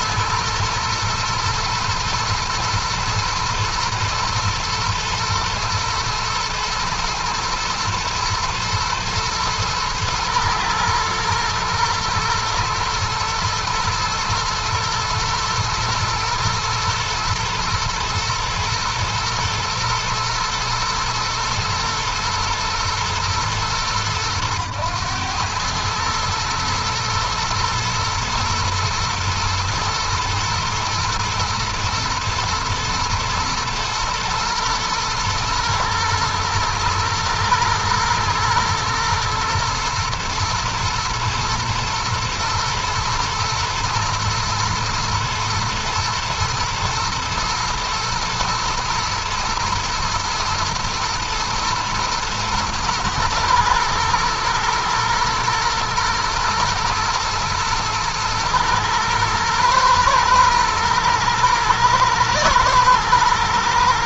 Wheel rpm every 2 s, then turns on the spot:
110, 110, 120, 120, 120, 120, 120, 120, 110, 110, 120, 110, 110, 110, 110, 120, 110, 120, 120, 110, 110, 120, 110, 110, 110, 110, 110, 110, 110, 120, 120, 120.
none